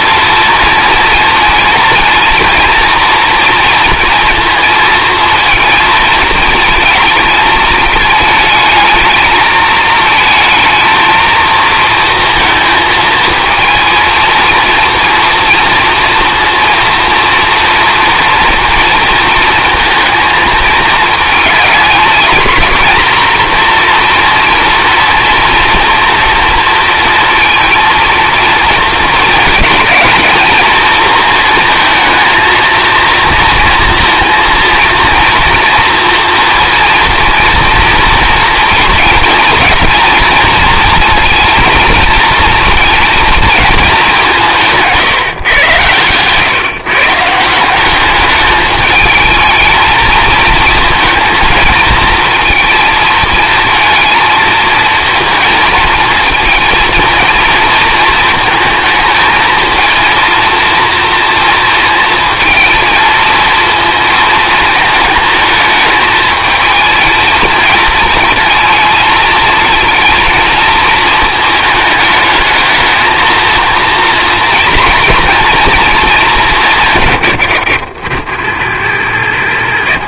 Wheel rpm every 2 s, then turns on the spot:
230, 230, 230, 220, 230, 230, 220, 230, 230, 220, 220, 240, 230, 230, 220, 230, 230, 230, 230, 230, 230, 210, 120, 190, 220, 220, 230, 230, 230, 230, 230, 230, 220, 230, 230, 210, 230, 220, 60, 50.
none